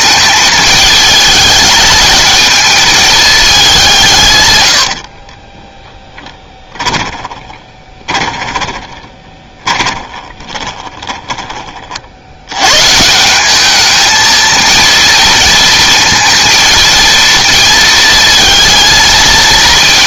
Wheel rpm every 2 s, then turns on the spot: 210, 220, 100, 10, 20, 20, 120, 230, 230, 230.
6-12